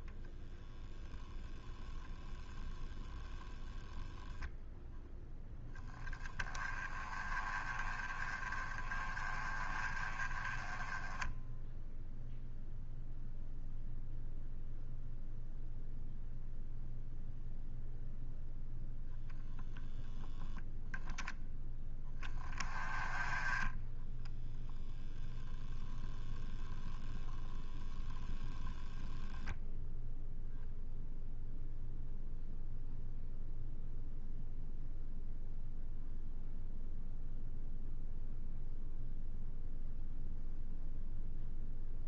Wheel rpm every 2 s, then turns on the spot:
0, 0, 0, 20, 20, 10, 0, 0, 0, 0, 0, 10, 0, 0, 0, 0, 0, 0, 0, 0, 0.
none